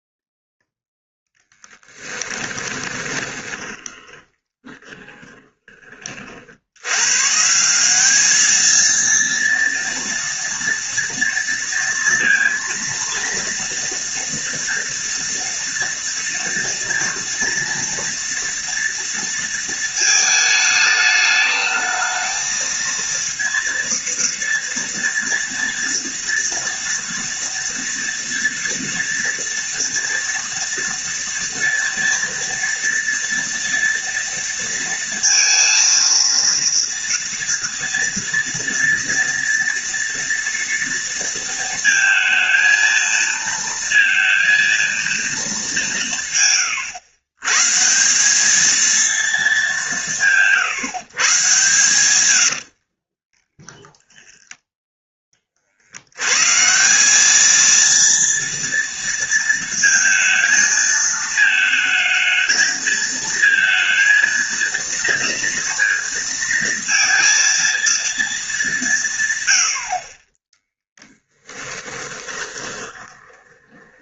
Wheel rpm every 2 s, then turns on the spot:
0, 20, 20, 90, 220, 230, 230, 230, 230, 230, 220, 230, 230, 230, 230, 230, 240, 230, 230, 230, 230, 230, 230, 120, 220, 130, 50, 10, 170, 230, 220, 220, 230, 230, 180, 10, 20.
2-6 46-48 52-54 70-74